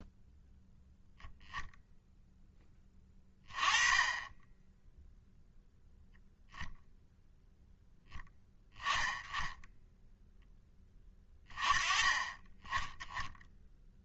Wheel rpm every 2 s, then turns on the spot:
0, 20, 0, 0, 10, 20, 10.
none